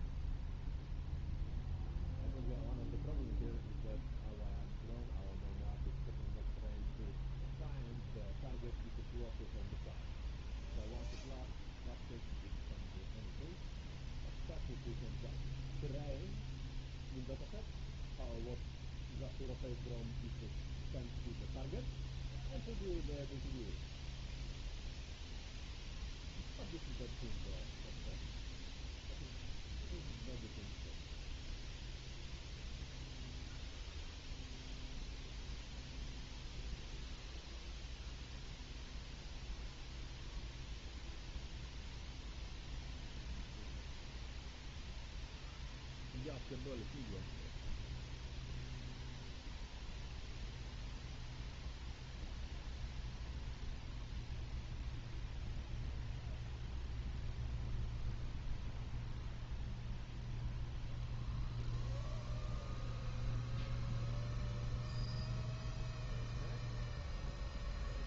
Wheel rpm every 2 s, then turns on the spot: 0, 0, 0, 0, 0, 0, 0, 0, 0, 0, 0, 0, 0, 0, 0, 0, 0, 0, 0, 0, 0, 0, 0, 0, 0, 0, 0, 0, 0, 0, 0, 0, 0, 0.
none